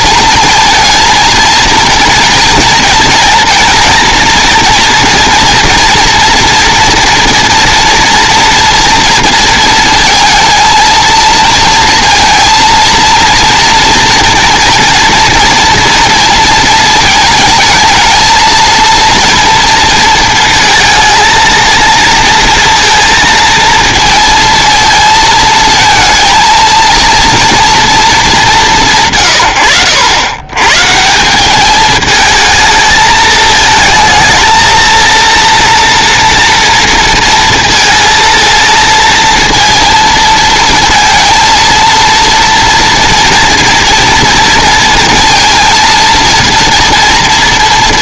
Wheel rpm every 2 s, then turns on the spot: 230, 240, 230, 230, 230, 230, 230, 230, 220, 230, 230, 230, 220, 230, 160, 130, 220, 220, 230, 230, 230, 230, 230, 230.
none